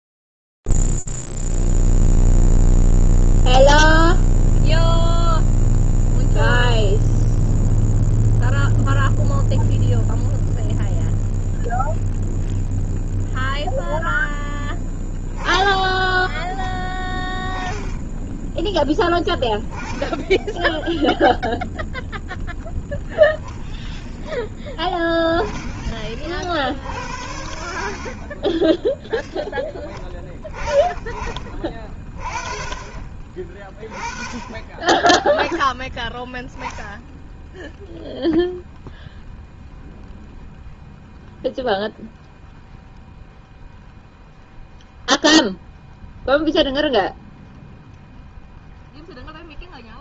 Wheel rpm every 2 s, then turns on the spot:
0, 0, 0, 0, 0, 0, 0, 0, 10, 10, 10, 0, 10, 60, 20, 30, 30, 20, 10, 0, 0, 0, 0, 0, 0.
none